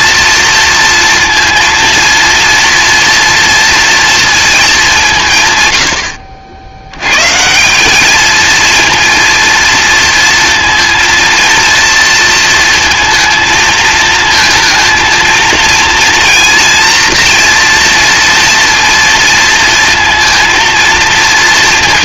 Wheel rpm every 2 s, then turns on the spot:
230, 230, 200, 90, 230, 230, 230, 230, 230, 230, 230.
none